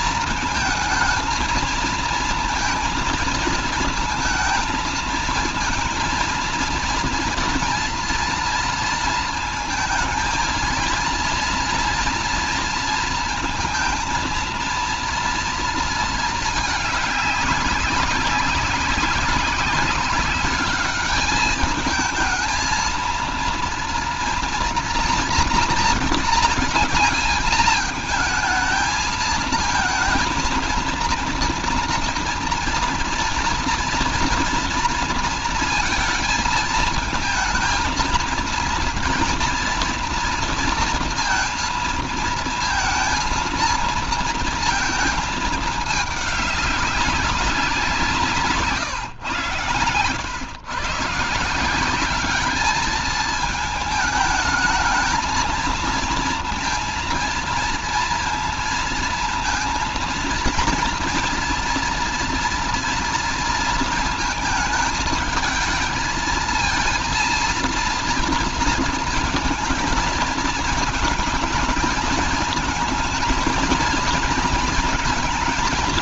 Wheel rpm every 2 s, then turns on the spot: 220, 230, 220, 230, 230, 230, 230, 230, 220, 200, 210, 220, 230, 220, 220, 220, 230, 230, 220, 230, 230, 230, 230, 200, 140, 120, 210, 220, 230, 230, 230, 230, 220, 230, 230, 220, 220, 230.
none